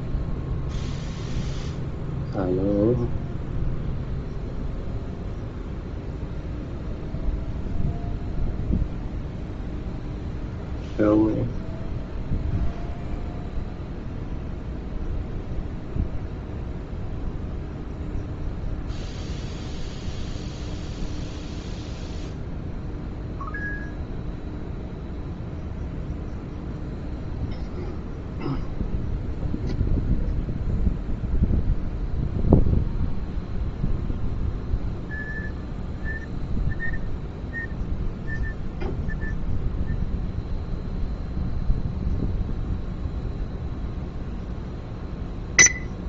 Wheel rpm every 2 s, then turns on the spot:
0, 0, 0, 0, 0, 0, 0, 0, 0, 0, 0, 0, 0, 0, 0, 0, 0, 0, 0, 0, 0, 0, 0.
none